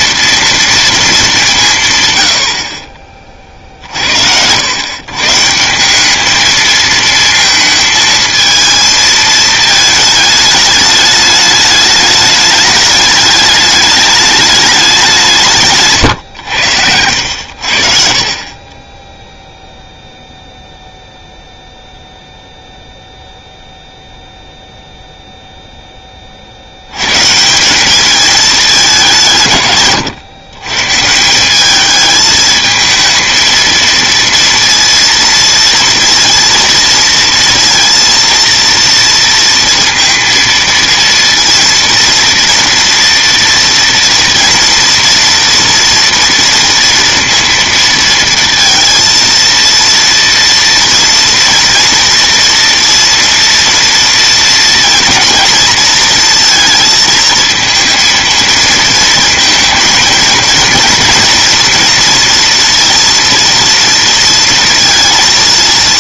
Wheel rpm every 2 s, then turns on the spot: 230, 60, 90, 220, 220, 210, 210, 210, 100, 40, 0, 0, 0, 60, 210, 120, 220, 230, 230, 230, 230, 240, 230, 230, 230, 230, 230, 230, 230, 220, 230, 230, 230.
18-20